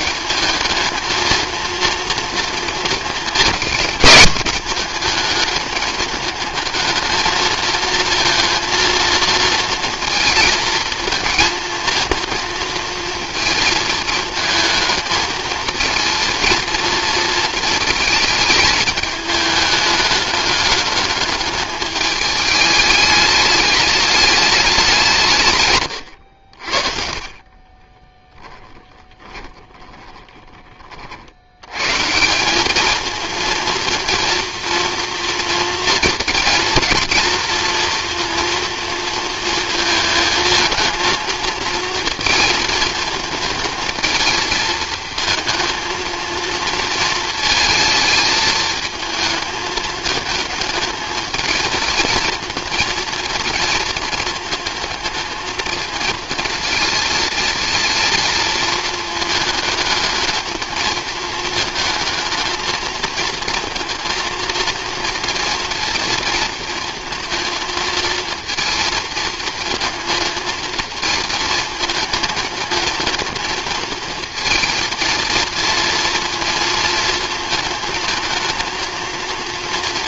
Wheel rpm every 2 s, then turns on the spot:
220, 230, 210, 220, 230, 220, 230, 220, 230, 210, 210, 210, 200, 60, 20, 30, 200, 230, 230, 230, 220, 220, 220, 230, 220, 220, 230, 220, 220, 230, 220, 220, 230, 220, 230, 220, 220, 230, 230, 220.
28-30